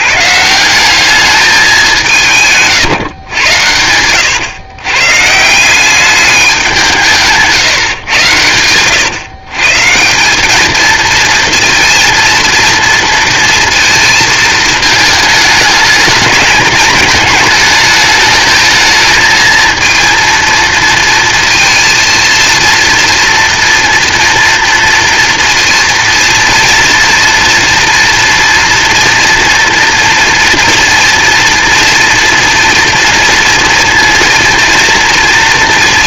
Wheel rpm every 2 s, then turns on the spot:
170, 140, 130, 190, 100, 210, 230, 220, 220, 220, 230, 230, 230, 230, 230, 230, 230, 230.
2-4